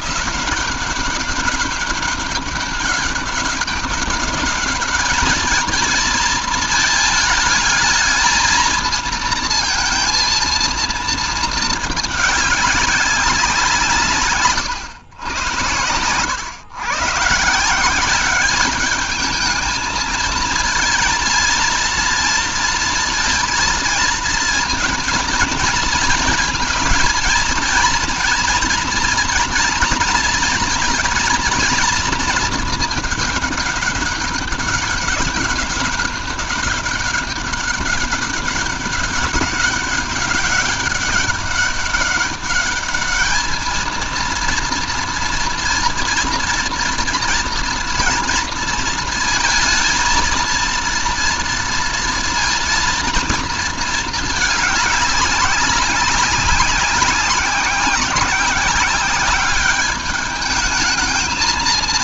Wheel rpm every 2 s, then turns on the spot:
190, 200, 210, 220, 220, 230, 190, 100, 140, 210, 230, 230, 230, 220, 230, 230, 210, 200, 200, 200, 200, 220, 240, 230, 230, 230, 230, 200, 200, 200, 220.
none